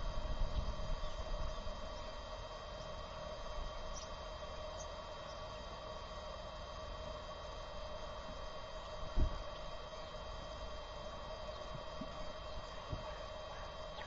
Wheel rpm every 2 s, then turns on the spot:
0, 0, 0, 0, 0, 0, 0.
none